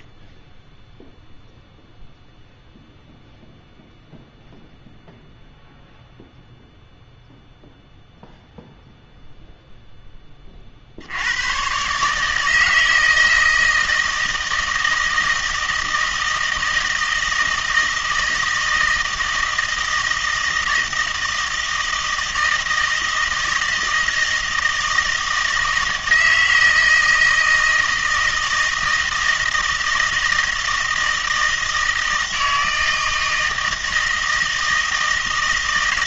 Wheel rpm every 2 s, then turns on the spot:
10, 0, 0, 0, 0, 40, 160, 160, 160, 160, 160, 160, 160, 160, 160, 160, 160, 160.
none